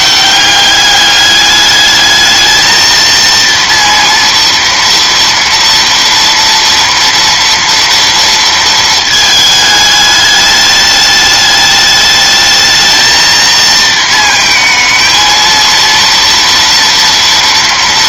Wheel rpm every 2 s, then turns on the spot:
180, 220, 230, 230, 230, 210, 220, 220, 230.
none